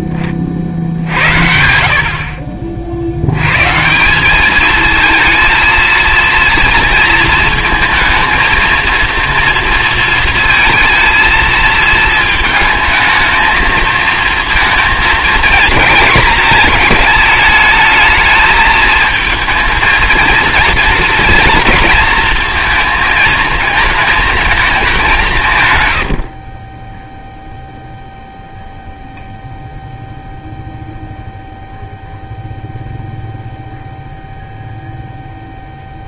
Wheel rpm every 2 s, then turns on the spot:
70, 60, 220, 230, 230, 220, 220, 230, 220, 220, 230, 230, 210, 30, 0, 0, 0, 0.
none